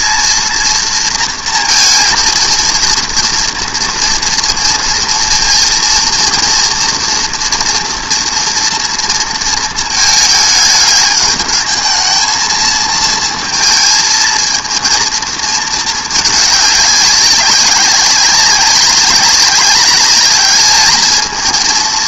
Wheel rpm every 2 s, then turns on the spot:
230, 230, 230, 240, 230, 210, 230, 230, 200, 190, 210.
none